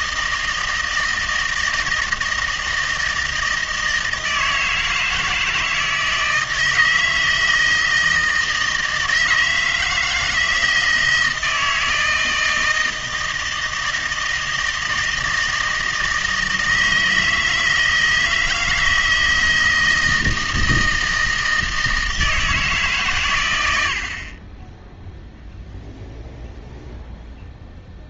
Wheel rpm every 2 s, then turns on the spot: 160, 160, 160, 160, 160, 160, 160, 160, 160, 160, 160, 150, 0, 0.
none